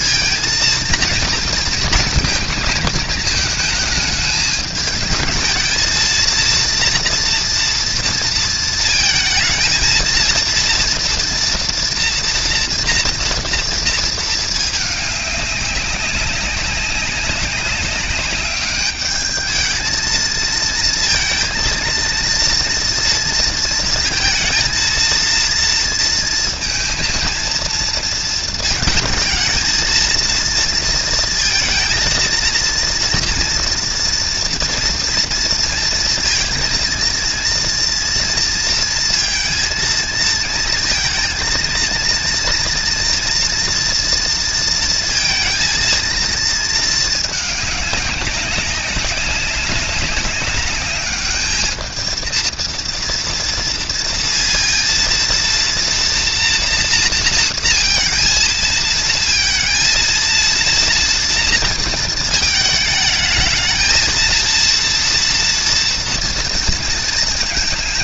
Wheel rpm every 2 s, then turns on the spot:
230, 230, 210, 230, 230, 230, 240, 220, 190, 200, 220, 230, 220, 230, 220, 230, 230, 230, 230, 230, 230, 230, 230, 220, 190, 200, 230, 230, 240, 230, 230, 220, 230, 230.
none